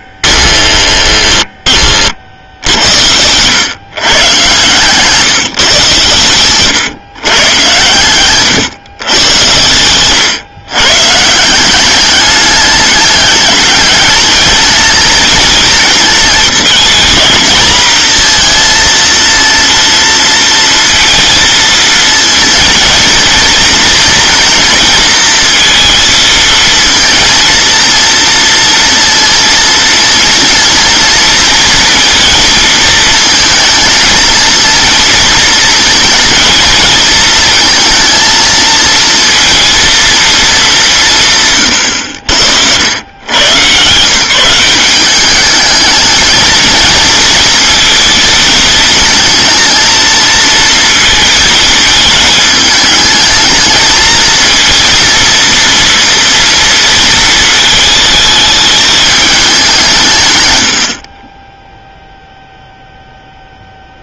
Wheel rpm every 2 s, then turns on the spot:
10, 70, 120, 120, 130, 130, 200, 220, 230, 230, 230, 230, 230, 230, 230, 230, 220, 230, 220, 230, 200, 90, 180, 220, 230, 230, 210, 230, 230, 210, 140, 0.
none